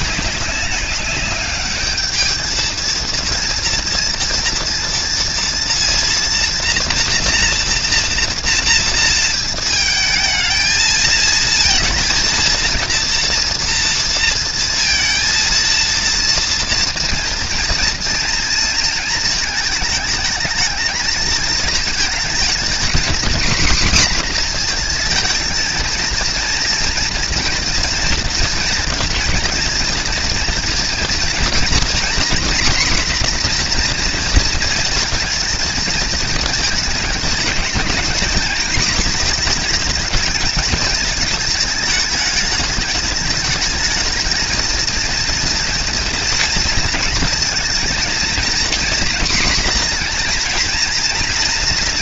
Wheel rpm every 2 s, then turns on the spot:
220, 230, 230, 230, 220, 230, 230, 230, 230, 220, 230, 250, 230, 230, 230, 250, 240, 220, 230, 220, 210, 220, 230, 230, 240, 230.
none